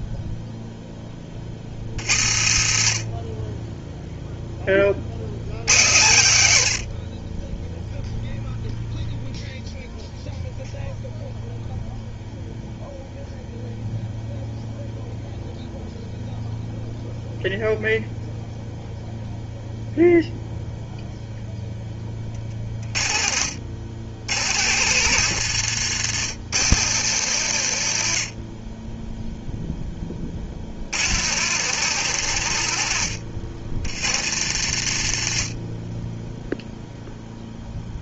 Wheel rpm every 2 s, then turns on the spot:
20, 50, 60, 80, 0, 0, 0, 0, 0, 0, 0, 40, 130, 120, 10, 90, 90, 70, 0.
none